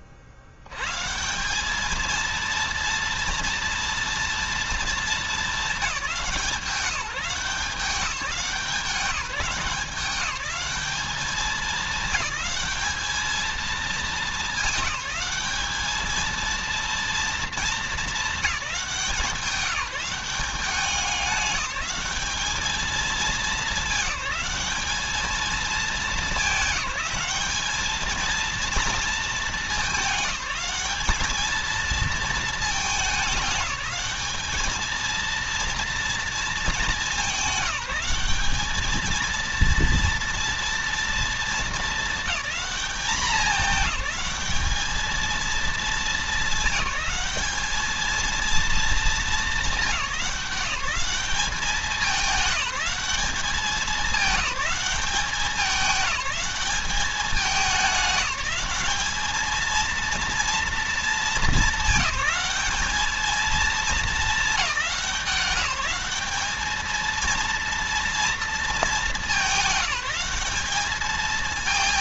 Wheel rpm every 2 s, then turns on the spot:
80, 230, 220, 180, 170, 200, 210, 210, 230, 210, 190, 210, 200, 210, 230, 190, 220, 220, 220, 200, 230, 210, 210, 210, 230, 200, 210, 210, 200, 210, 230, 210, 210, 220, 220, 200.
none